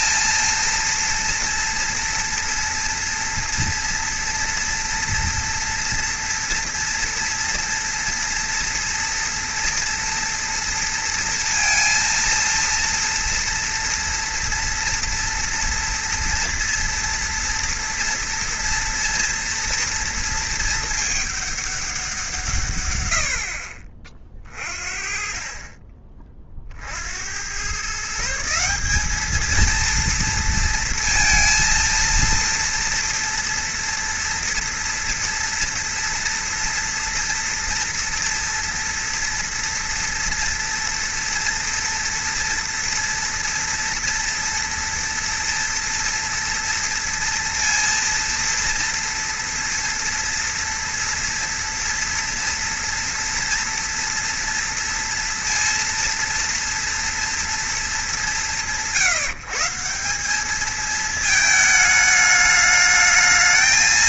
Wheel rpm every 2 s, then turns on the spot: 230, 230, 230, 230, 230, 230, 230, 230, 240, 240, 220, 100, 40, 50, 200, 230, 230, 230, 230, 230, 230, 230, 230, 230, 230, 230, 230, 230, 230, 150, 220, 210.
none